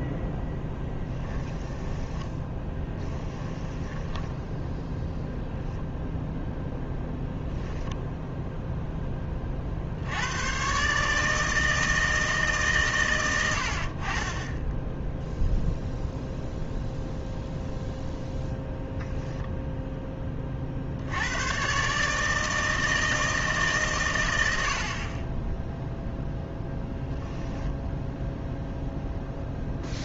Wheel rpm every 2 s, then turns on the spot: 10, 10, 0, 0, 10, 130, 140, 10, 0, 0, 60, 160, 70, 0, 0.
0-4